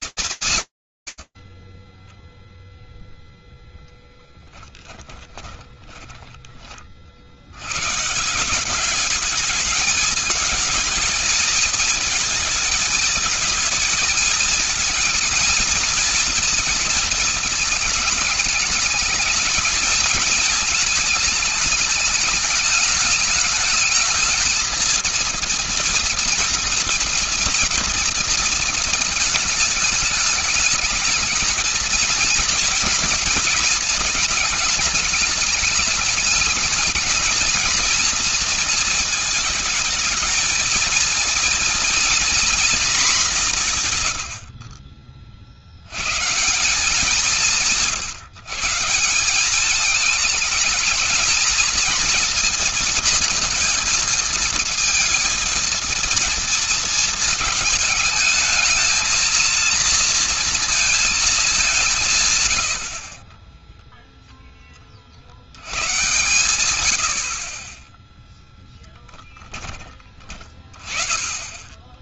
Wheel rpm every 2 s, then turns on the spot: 190, 0, 10, 30, 170, 220, 220, 230, 230, 210, 220, 210, 220, 230, 230, 210, 230, 220, 220, 230, 230, 240, 80, 170, 160, 220, 230, 220, 220, 220, 230, 90, 20, 100, 10, 30.
4-6 44-46 68-70